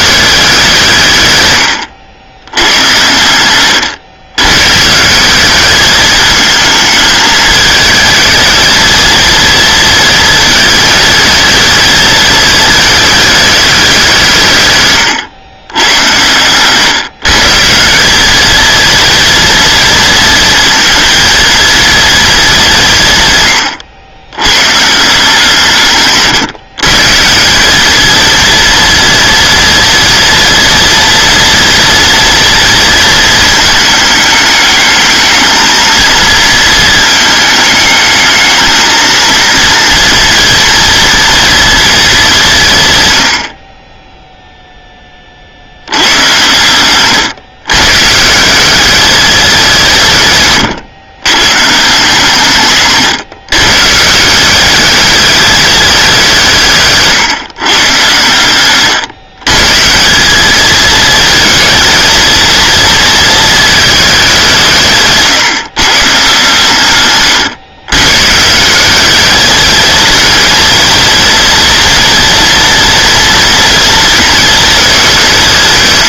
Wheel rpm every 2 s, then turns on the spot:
160, 100, 160, 220, 230, 220, 220, 130, 140, 230, 230, 160, 160, 160, 240, 230, 220, 220, 230, 230, 230, 100, 10, 130, 210, 120, 140, 200, 150, 110, 220, 230, 160, 120, 190, 230, 230, 200.
52-54